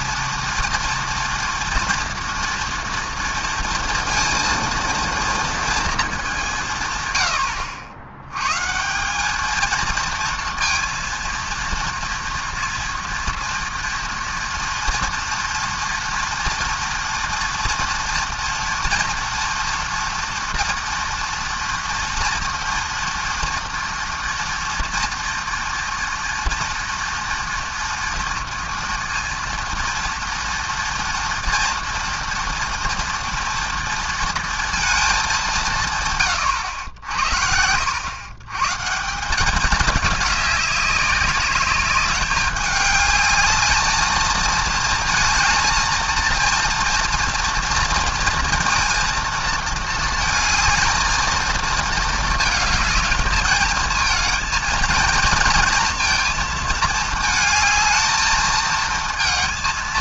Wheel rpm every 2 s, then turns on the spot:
230, 230, 230, 140, 170, 230, 230, 230, 230, 230, 240, 240, 230, 230, 230, 240, 230, 220, 90, 150, 200, 210, 220, 230, 230, 220, 220, 230, 220, 220.
none